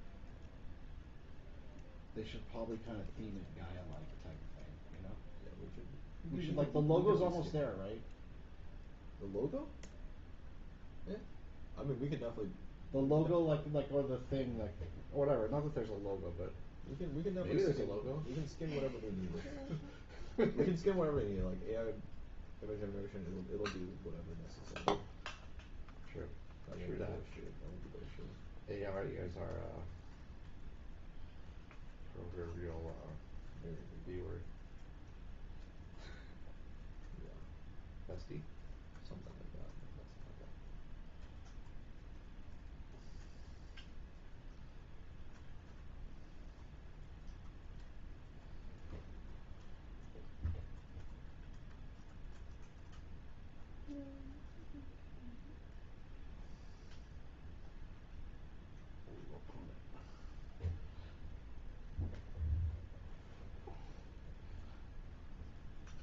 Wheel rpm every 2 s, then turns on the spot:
0, 0, 0, 0, 0, 0, 0, 0, 0, 0, 0, 0, 0, 0, 0, 0, 0, 0, 0, 0, 0, 0, 0, 0, 0, 0, 0, 0, 0, 0, 0, 0, 0.
none